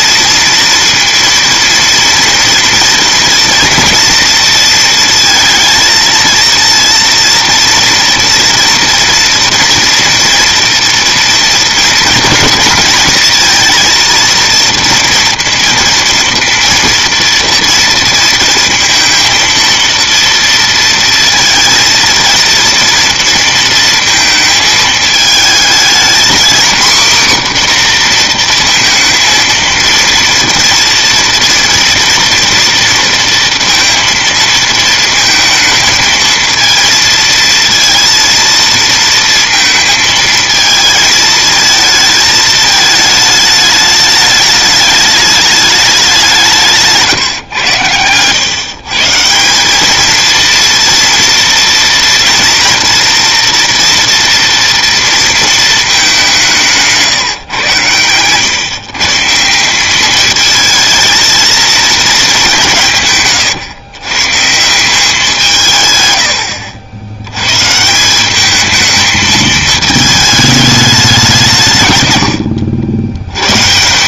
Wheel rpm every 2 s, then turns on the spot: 230, 230, 230, 230, 230, 230, 220, 230, 230, 230, 230, 230, 220, 240, 230, 230, 230, 230, 220, 230, 220, 220, 210, 170, 130, 230, 230, 230, 180, 130, 220, 180, 150, 80, 210, 210, 80.
none